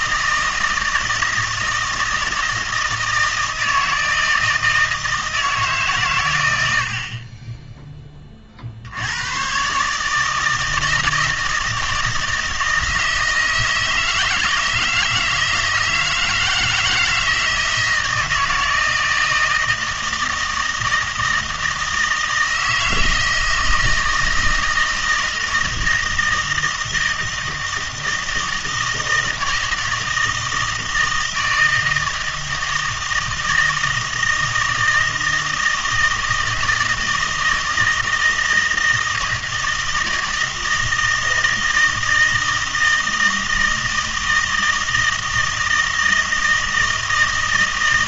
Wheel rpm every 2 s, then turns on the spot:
160, 160, 160, 80, 60, 160, 160, 160, 160, 160, 160, 160, 160, 160, 160, 160, 160, 160, 160, 160, 160, 160, 160, 160.
none